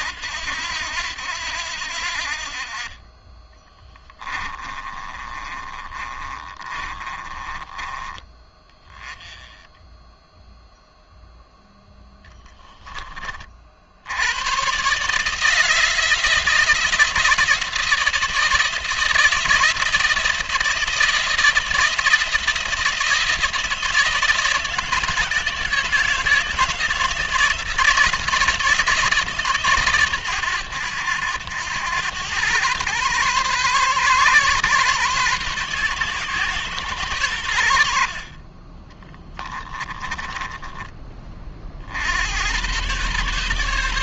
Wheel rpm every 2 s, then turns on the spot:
80, 30, 20, 30, 20, 0, 20, 140, 170, 170, 170, 170, 160, 160, 160, 100, 120, 130, 120, 20, 20, 120.
4-8 38-40